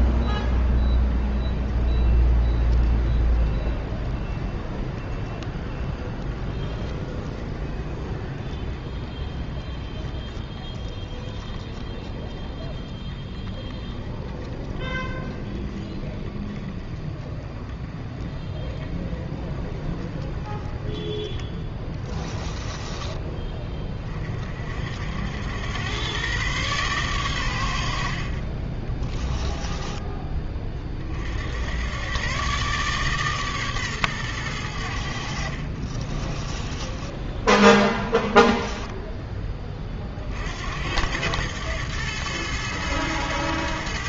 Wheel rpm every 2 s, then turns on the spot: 10, 20, 20, 20, 20, 20, 20, 20, 20, 20, 10, 20, 50, 130, 30, 30, 140, 90, 20, 10, 80, 110.
22-24 36-40